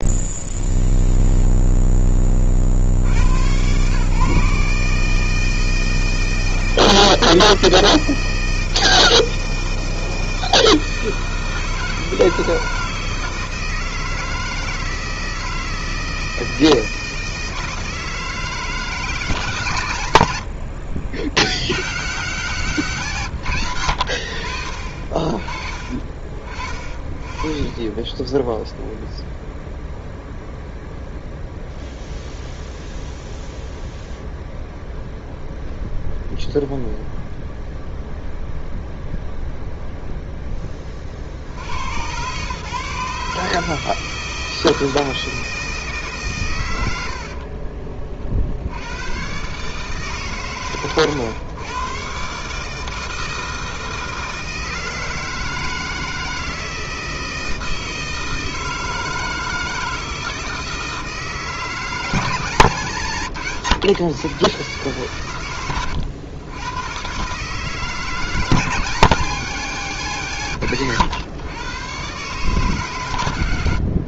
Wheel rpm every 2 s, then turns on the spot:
0, 40, 140, 160, 160, 160, 160, 160, 160, 160, 70, 160, 60, 40, 0, 0, 0, 0, 0, 0, 10, 140, 160, 110, 70, 130, 150, 160, 160, 160, 160, 160, 120, 100, 170, 130, 140.
none